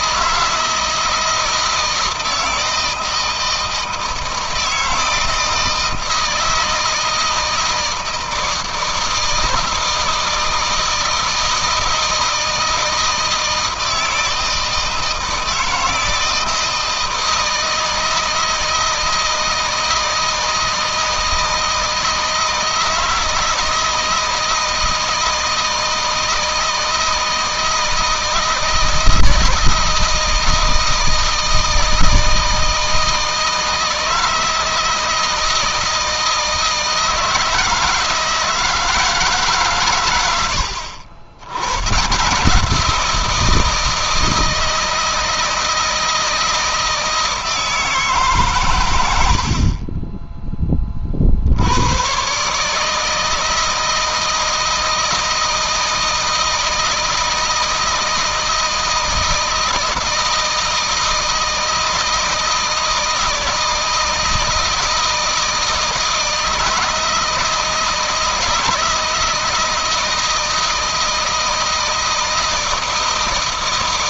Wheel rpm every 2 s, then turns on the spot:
160, 160, 160, 160, 160, 160, 160, 160, 160, 160, 160, 160, 160, 160, 160, 160, 160, 160, 160, 160, 80, 180, 160, 160, 110, 30, 150, 160, 160, 160, 160, 160, 160, 160, 160, 160, 160.
none